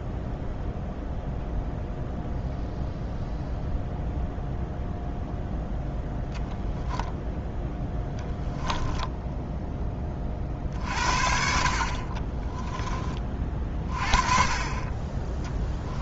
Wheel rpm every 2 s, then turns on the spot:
0, 0, 0, 0, 10, 50, 20, 20.
8-10